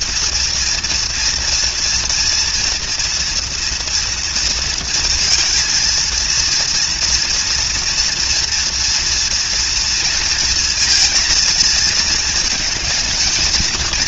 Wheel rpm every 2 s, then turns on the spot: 230, 230, 230, 230, 240, 230, 230.
none